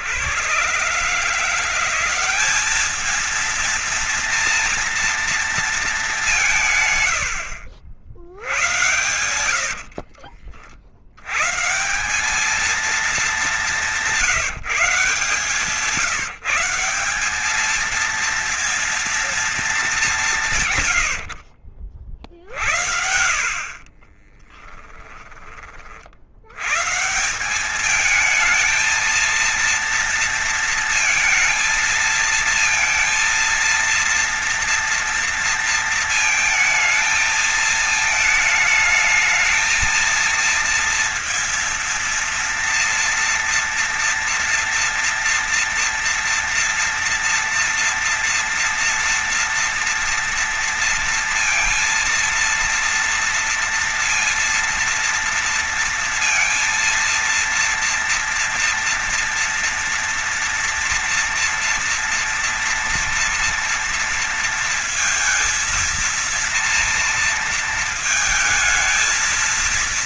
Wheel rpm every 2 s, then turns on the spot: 140, 210, 230, 120, 110, 90, 220, 180, 190, 230, 110, 60, 20, 150, 230, 230, 230, 230, 230, 220, 230, 230, 230, 230, 230, 230, 230, 230, 230, 230, 230, 230, 230, 230, 220.
8-10 22-24